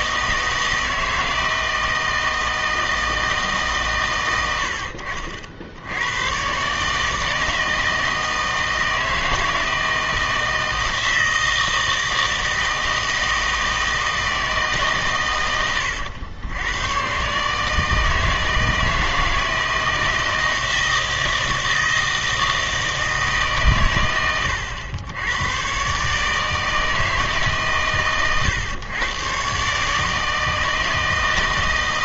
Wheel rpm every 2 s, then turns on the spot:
160, 160, 90, 130, 160, 160, 160, 150, 100, 160, 160, 160, 100, 160, 120, 160.
none